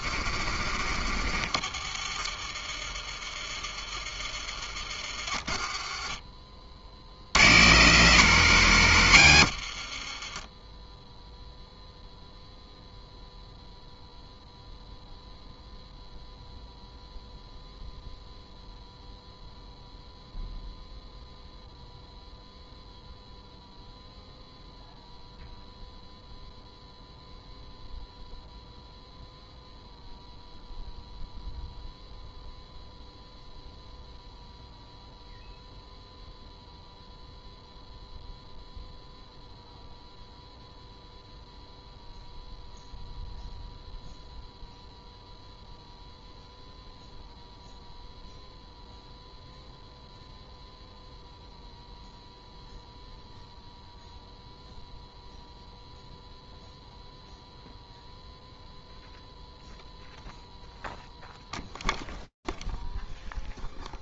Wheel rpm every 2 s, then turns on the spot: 60, 40, 40, 40, 180, 20, 0, 0, 0, 0, 0, 0, 0, 0, 0, 0, 0, 0, 0, 0, 0, 0, 0, 0, 0, 0, 0, 0, 0, 0, 0, 0.
10-12